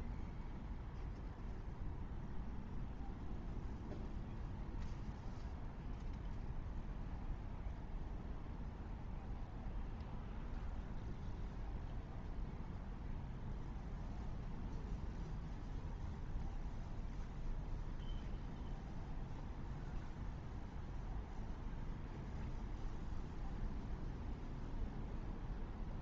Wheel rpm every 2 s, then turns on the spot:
0, 0, 0, 0, 0, 0, 0, 0, 0, 0, 0, 0, 0.
none